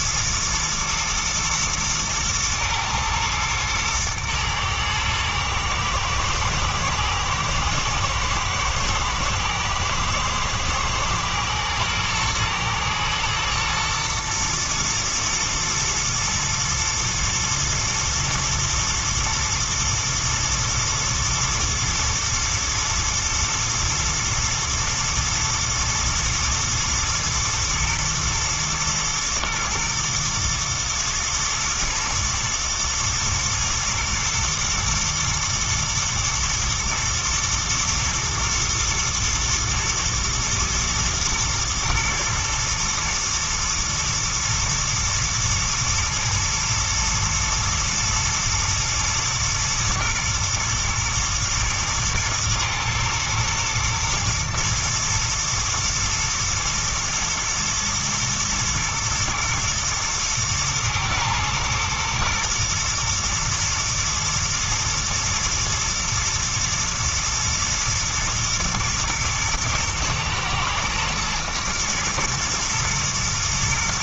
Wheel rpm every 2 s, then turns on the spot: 110, 110, 110, 110, 110, 110, 120, 120, 120, 120, 120, 120, 110, 120, 120, 110, 110, 110, 120, 120, 110, 110, 110, 110, 110, 110, 110, 110, 110, 110, 110, 120, 110, 110, 120, 110, 110.
none